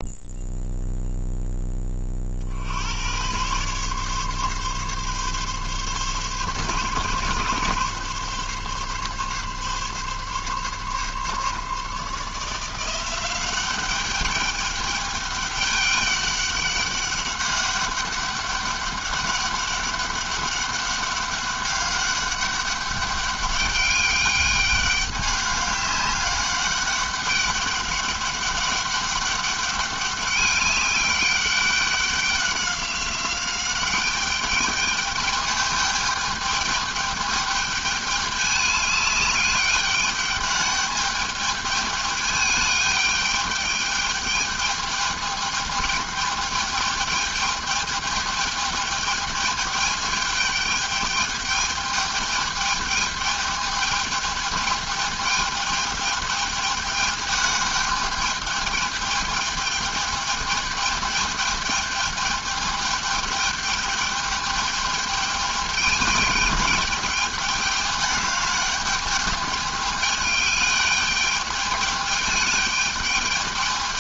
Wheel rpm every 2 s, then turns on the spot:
0, 90, 140, 140, 140, 140, 170, 200, 200, 200, 200, 200, 200, 200, 200, 200, 190, 210, 210, 210, 210, 210, 210, 210, 210, 210, 210, 210, 210, 210, 210, 210, 210, 210, 210, 210, 210.
none